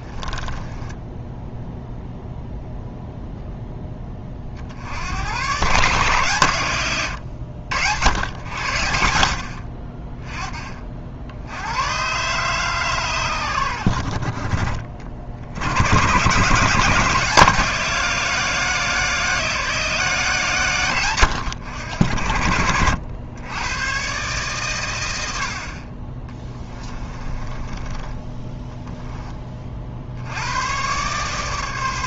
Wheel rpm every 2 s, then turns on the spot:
10, 0, 50, 120, 90, 30, 140, 40, 150, 170, 140, 80, 120, 20, 10, 110.
0-2 26-30